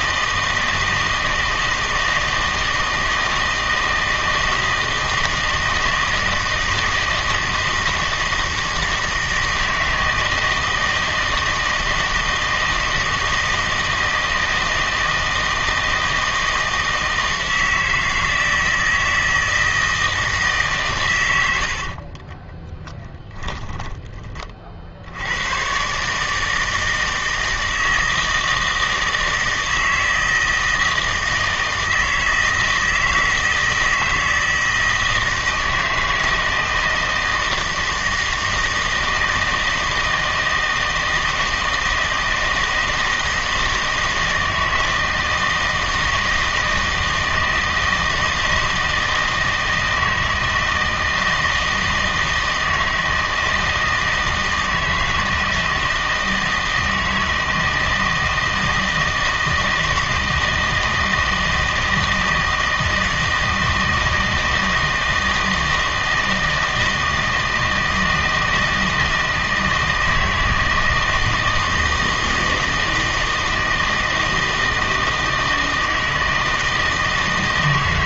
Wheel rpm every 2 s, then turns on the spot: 160, 160, 160, 160, 160, 160, 160, 160, 160, 160, 140, 10, 50, 160, 160, 160, 160, 160, 160, 160, 160, 160, 160, 160, 160, 160, 160, 160, 160, 160, 160, 160, 160, 160, 160, 160, 160, 160, 160.
22-24